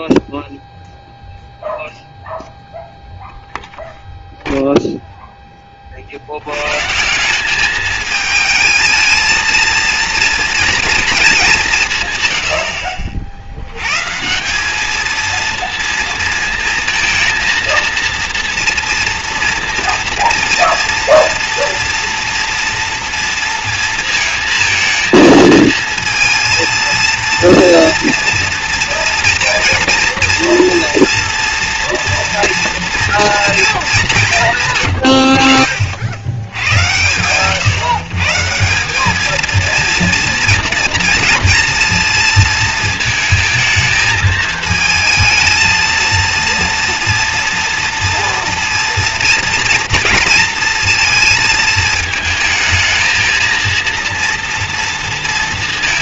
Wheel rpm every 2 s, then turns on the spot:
0, 0, 0, 90, 220, 230, 110, 170, 230, 230, 230, 230, 230, 230, 230, 230, 230, 160, 90, 140, 230, 230, 220, 230, 230, 230, 220, 230.
none